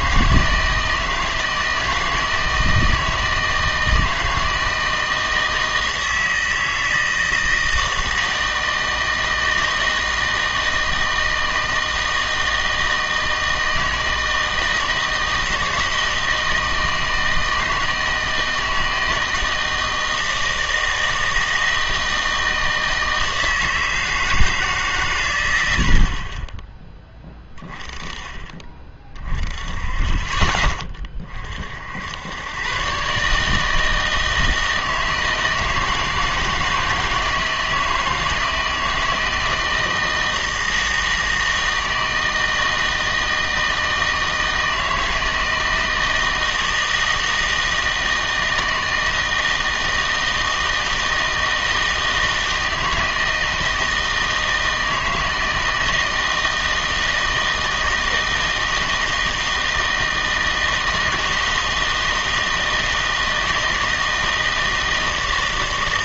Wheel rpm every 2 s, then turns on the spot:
160, 160, 160, 160, 160, 160, 160, 160, 160, 160, 160, 160, 150, 20, 30, 20, 120, 160, 160, 160, 160, 160, 160, 160, 160, 160, 160, 160, 160, 160, 160, 160, 160.
none